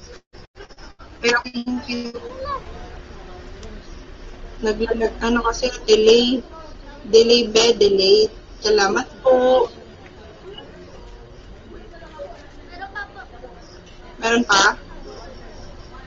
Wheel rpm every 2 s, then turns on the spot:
0, 0, 0, 0, 0, 0, 0, 0.
none